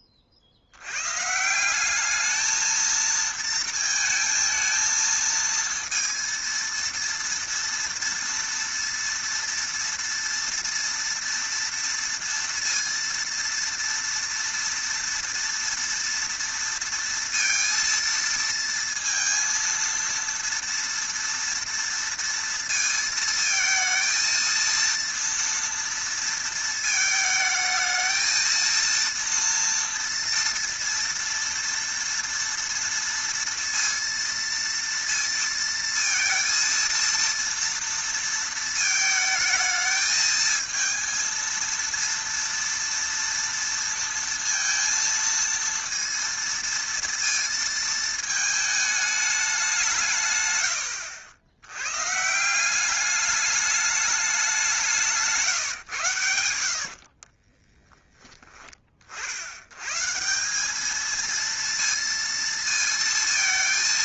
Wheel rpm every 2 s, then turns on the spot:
70, 220, 220, 230, 230, 230, 230, 230, 230, 230, 230, 230, 230, 230, 230, 230, 230, 230, 230, 220, 230, 230, 230, 230, 220, 100, 170, 190, 80, 30, 200, 230.
none